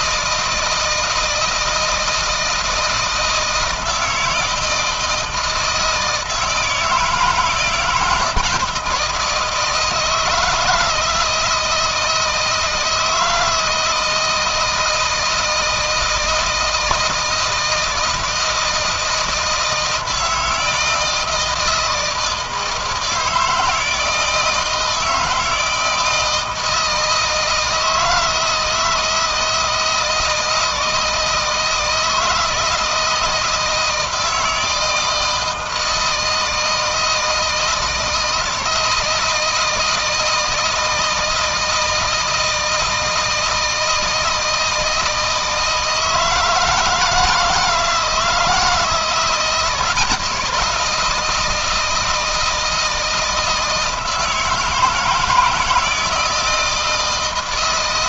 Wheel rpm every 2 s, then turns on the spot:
160, 160, 160, 160, 160, 160, 160, 160, 160, 160, 160, 160, 160, 160, 160, 160, 170, 160, 160, 160, 160, 160, 160, 160, 170, 170, 160, 160, 160.
none